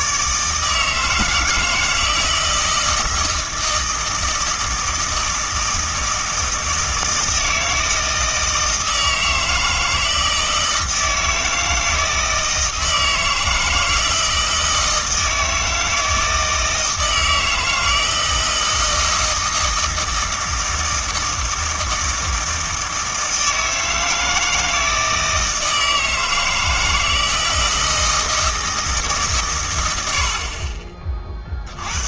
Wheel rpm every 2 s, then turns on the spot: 160, 160, 160, 160, 160, 160, 160, 160, 160, 160, 160, 160, 160, 160, 160, 40.
none